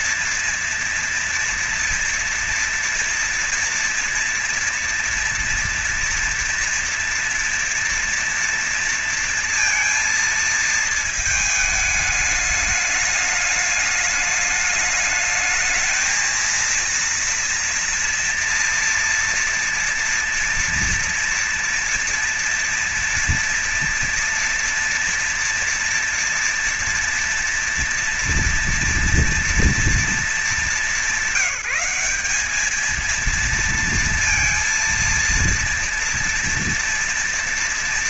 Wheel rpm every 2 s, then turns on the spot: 230, 230, 230, 230, 230, 230, 220, 210, 230, 230, 230, 230, 230, 240, 230, 210, 200, 230, 230.
none